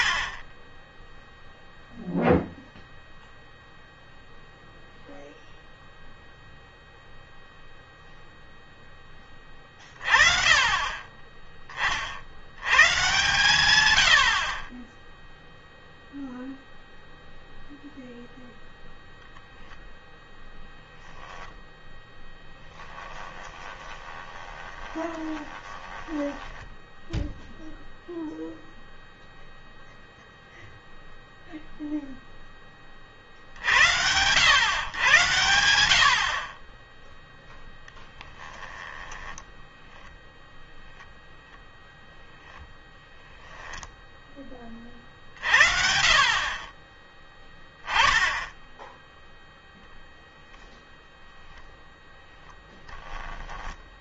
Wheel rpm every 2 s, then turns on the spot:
40, 0, 0, 0, 0, 30, 70, 50, 0, 0, 0, 10, 20, 10, 0, 0, 0, 90, 60, 10, 0, 0, 20, 30, 0, 0, 0.
22-28 38-40